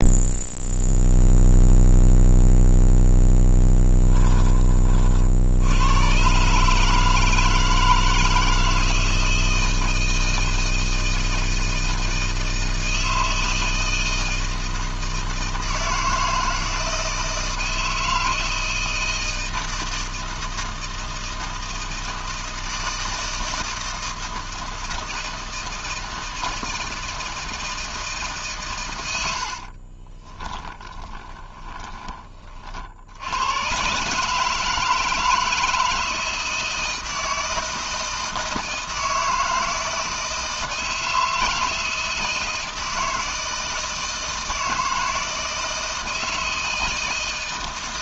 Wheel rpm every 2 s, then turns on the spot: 0, 0, 20, 140, 160, 160, 160, 160, 160, 160, 160, 160, 160, 160, 130, 10, 40, 160, 160, 160, 160, 160, 160, 160.
30-32